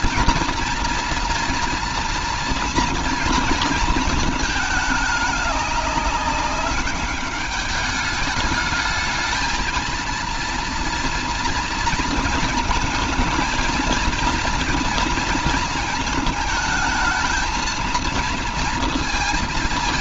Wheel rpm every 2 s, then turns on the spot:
230, 230, 220, 200, 210, 230, 230, 230, 220, 230.
none